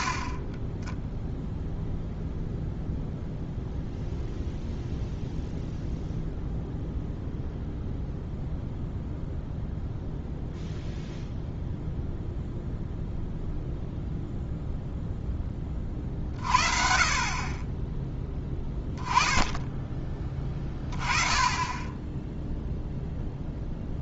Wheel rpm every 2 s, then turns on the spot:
10, 0, 0, 0, 0, 0, 0, 0, 40, 20, 20, 0.
none